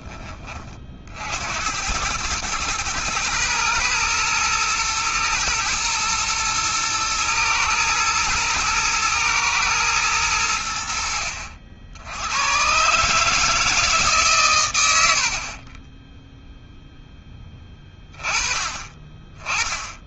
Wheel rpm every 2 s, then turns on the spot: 60, 110, 110, 110, 110, 70, 140, 100, 0, 20.
14-16